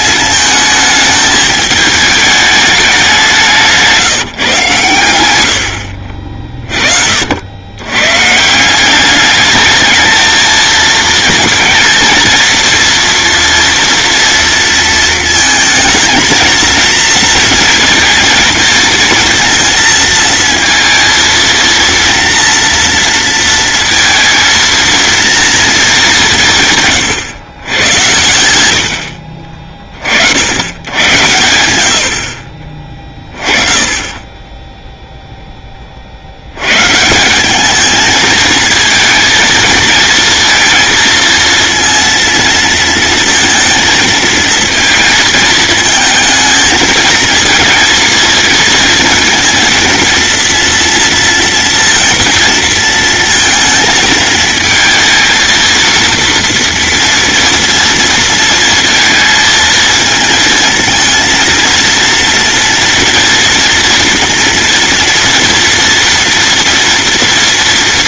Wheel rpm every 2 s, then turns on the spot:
220, 200, 120, 40, 180, 220, 230, 230, 220, 230, 230, 230, 230, 150, 80, 90, 40, 10, 120, 230, 230, 230, 220, 220, 220, 230, 230, 220, 230, 230, 230, 230, 230, 230.
none